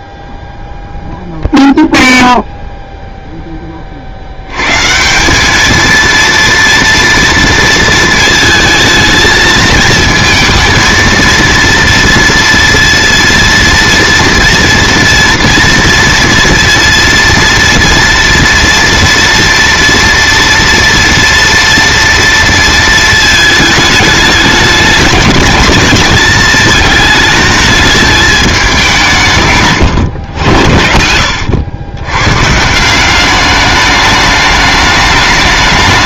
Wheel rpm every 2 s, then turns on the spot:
0, 0, 110, 230, 220, 230, 230, 240, 230, 230, 230, 230, 210, 220, 200, 90, 150, 210.
none